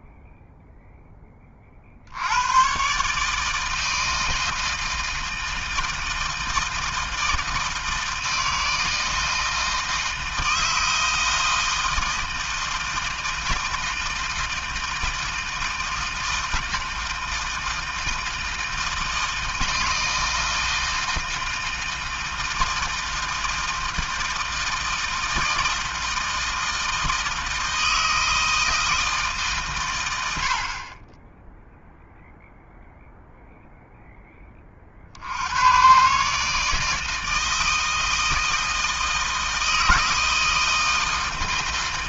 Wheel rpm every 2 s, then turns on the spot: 10, 140, 160, 160, 160, 160, 160, 160, 160, 160, 160, 160, 160, 160, 160, 20, 0, 70, 160, 160, 160.
none